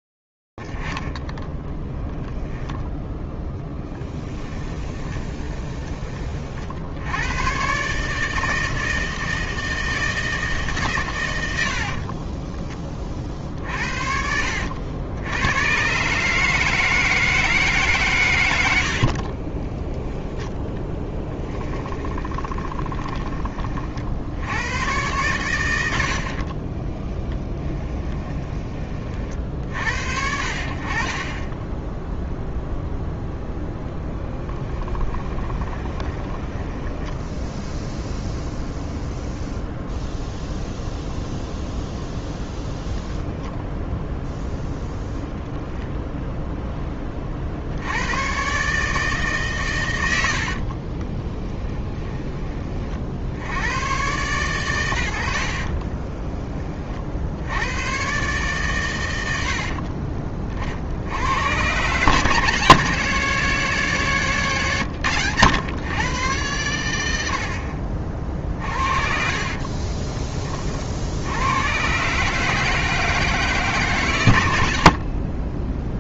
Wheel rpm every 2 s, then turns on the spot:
60, 10, 30, 10, 120, 150, 30, 70, 150, 80, 10, 20, 100, 40, 20, 50, 0, 20, 10, 0, 0, 10, 0, 10, 140, 50, 30, 110, 20, 120, 50, 160, 120, 100, 50, 60, 150, 90.
6-8 18-20 22-24 26-28 34-38 42-44 50-52 64-66 68-70